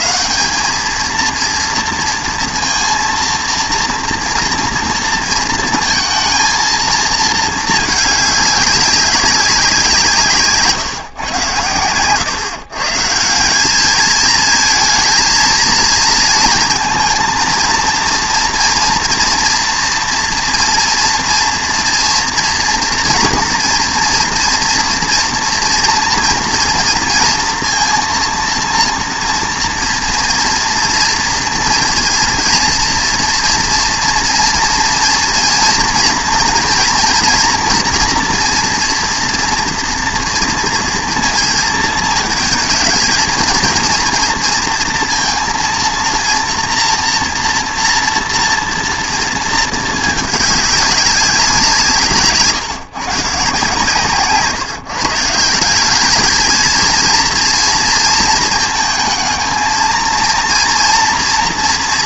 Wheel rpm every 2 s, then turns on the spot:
210, 230, 230, 230, 210, 150, 130, 220, 230, 230, 230, 230, 230, 230, 230, 230, 230, 230, 230, 230, 230, 220, 230, 230, 240, 210, 160, 160, 230, 220, 230.
none